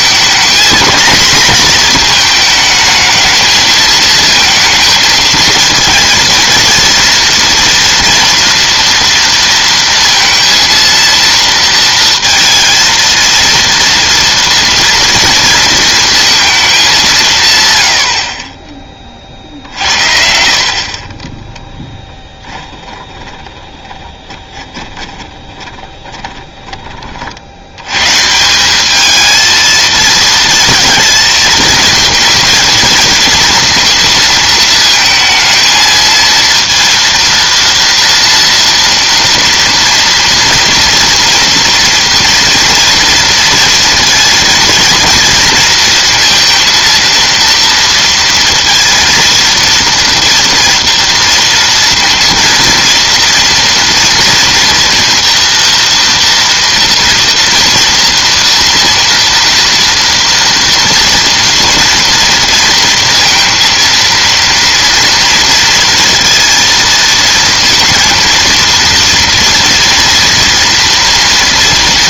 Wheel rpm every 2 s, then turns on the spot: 230, 230, 220, 220, 240, 230, 230, 230, 230, 50, 60, 10, 30, 10, 160, 230, 220, 230, 230, 230, 230, 230, 230, 230, 230, 230, 230, 230, 230, 230, 230, 230, 230, 230, 230, 230.
22-28